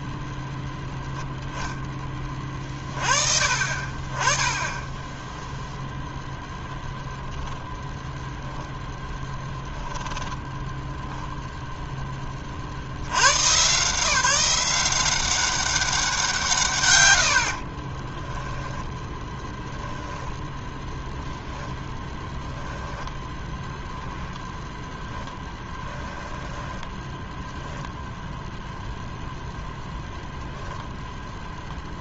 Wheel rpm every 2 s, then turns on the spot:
0, 30, 10, 0, 0, 10, 30, 170, 140, 10, 0, 0, 0, 10, 0, 0.
10-12 26-28